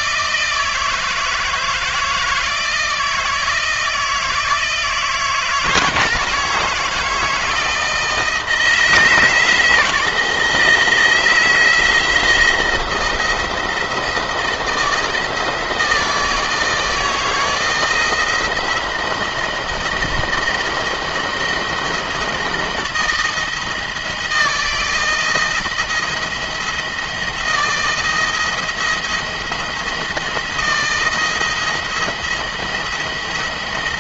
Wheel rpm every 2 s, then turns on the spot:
160, 160, 160, 160, 160, 160, 170, 160, 160, 170, 160, 160, 170, 170, 170, 170, 170.
none